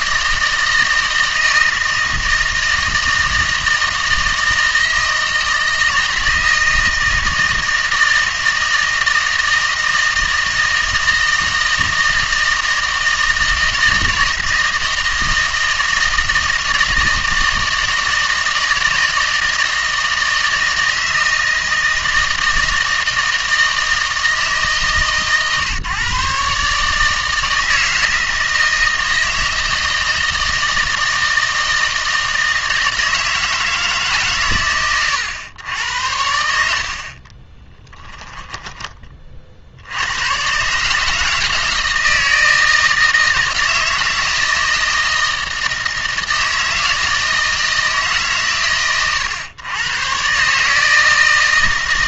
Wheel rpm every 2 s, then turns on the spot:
160, 160, 160, 160, 160, 160, 160, 160, 160, 160, 160, 160, 150, 150, 160, 160, 160, 130, 60, 20, 140, 160, 160, 160, 130, 150.
38-40